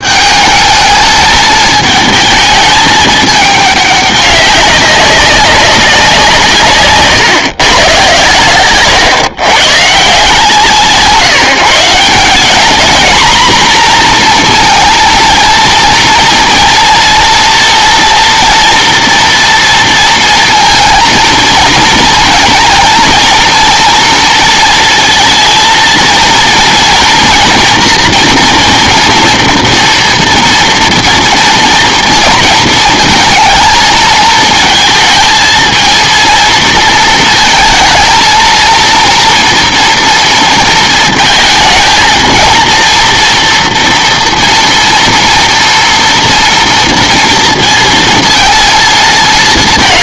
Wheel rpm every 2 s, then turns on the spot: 220, 220, 200, 160, 120, 150, 230, 230, 230, 230, 230, 230, 230, 230, 230, 230, 220, 230, 230, 230, 230, 230, 230, 230, 230.
none